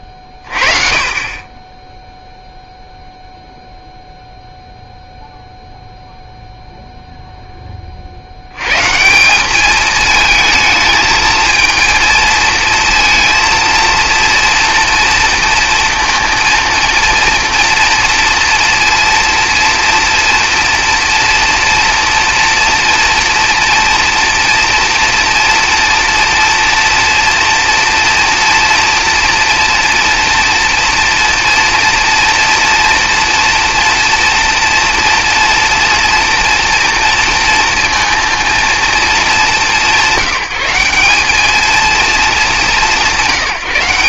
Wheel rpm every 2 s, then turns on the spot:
40, 0, 0, 0, 110, 220, 230, 230, 230, 230, 230, 240, 230, 230, 230, 230, 230, 230, 240, 230, 190, 180.
none